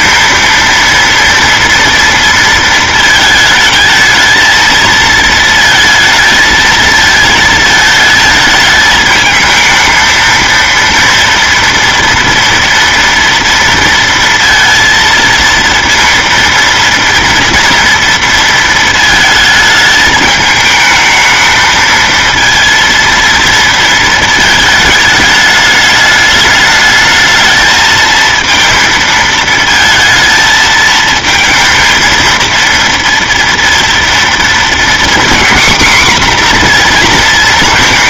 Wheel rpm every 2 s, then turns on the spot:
230, 220, 230, 220, 220, 230, 230, 230, 230, 230, 220, 230, 220, 210, 230, 220, 230, 230, 240.
none